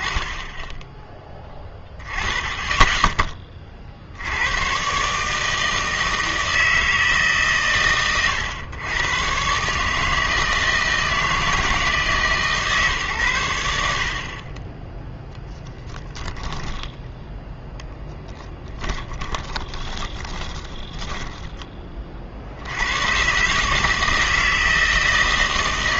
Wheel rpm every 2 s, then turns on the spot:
10, 20, 120, 160, 110, 160, 140, 0, 10, 10, 20, 100, 160.
16-22